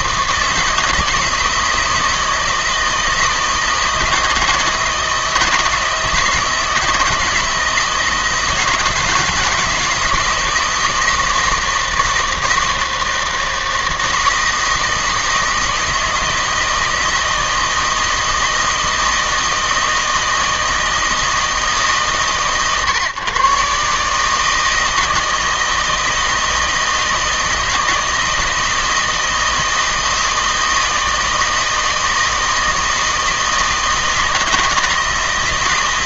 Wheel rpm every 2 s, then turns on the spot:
160, 160, 160, 160, 160, 160, 160, 160, 160, 160, 160, 130, 160, 160, 160, 160, 160, 160.
none